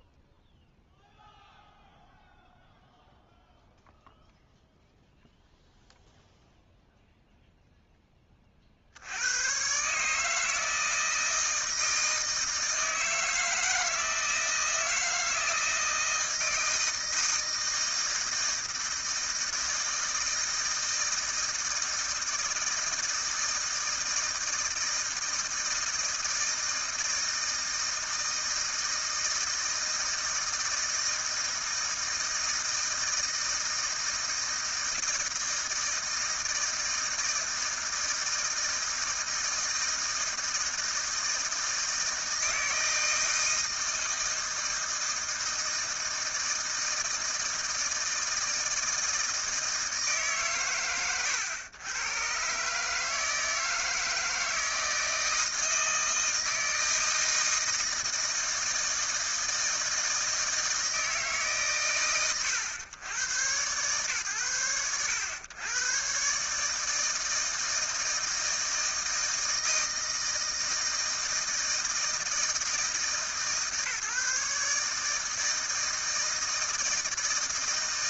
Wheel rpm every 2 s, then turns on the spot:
0, 0, 0, 10, 140, 160, 160, 160, 160, 160, 160, 160, 160, 160, 160, 160, 160, 160, 160, 160, 160, 160, 160, 160, 160, 100, 160, 160, 160, 160, 140, 110, 100, 160, 160, 160, 150, 160, 160.
none